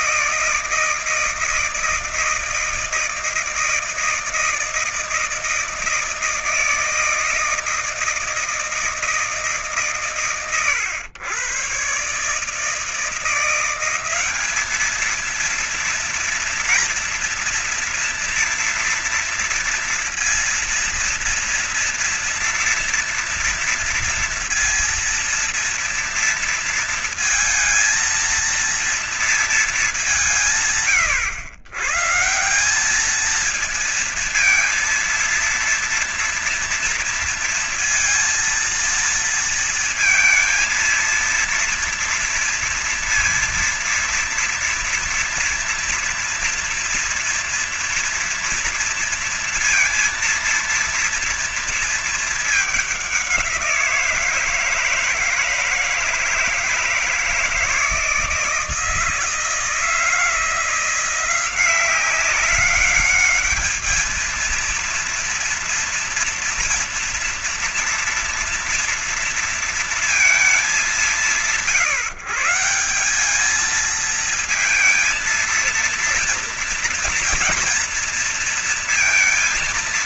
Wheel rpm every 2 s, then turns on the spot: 160, 160, 160, 160, 160, 110, 140, 200, 230, 240, 230, 230, 230, 230, 230, 150, 170, 230, 230, 230, 230, 230, 230, 230, 230, 230, 210, 160, 160, 160, 170, 190, 220, 230, 230, 190, 160, 220, 230, 230.
none